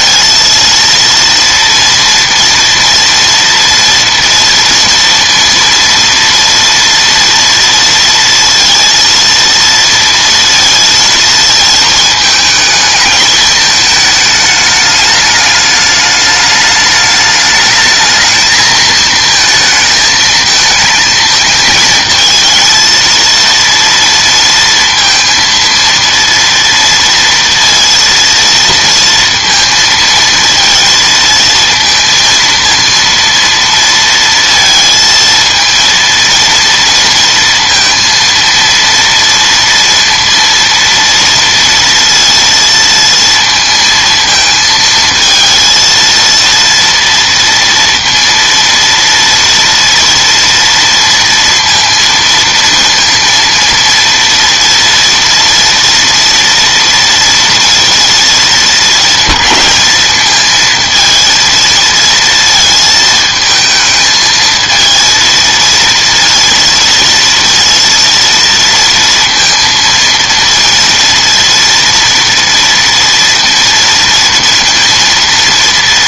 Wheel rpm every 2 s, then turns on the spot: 230, 230, 230, 230, 230, 230, 220, 210, 210, 220, 220, 220, 230, 230, 230, 230, 230, 230, 230, 230, 230, 230, 220, 230, 230, 230, 230, 230, 230, 220, 220, 220, 220, 230, 230, 230, 230, 230.
none